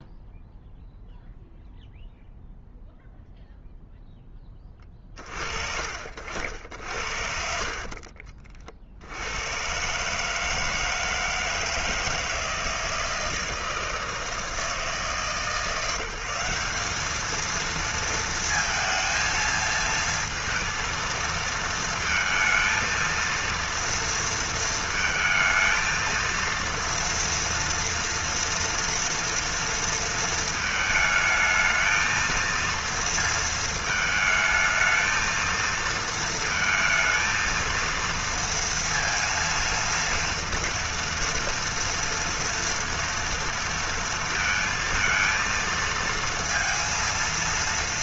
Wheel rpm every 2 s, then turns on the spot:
0, 0, 30, 70, 60, 160, 160, 160, 200, 230, 230, 230, 230, 230, 230, 220, 230, 220, 230, 230, 230, 230, 230, 230.
none